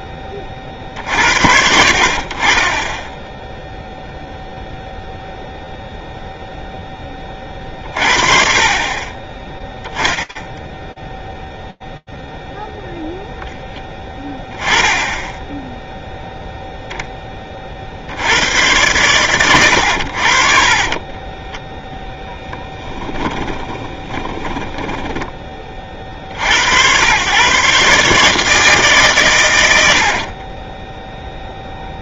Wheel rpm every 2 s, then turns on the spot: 30, 10, 0, 30, 10, 0, 10, 0, 50, 80, 10, 30, 40, 140, 60, 0.
20-24